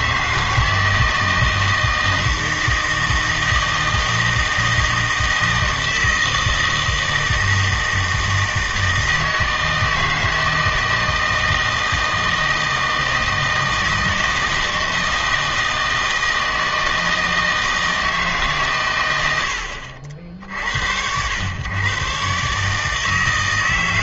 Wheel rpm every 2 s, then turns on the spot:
160, 160, 160, 160, 160, 160, 160, 160, 160, 130, 70, 150.
none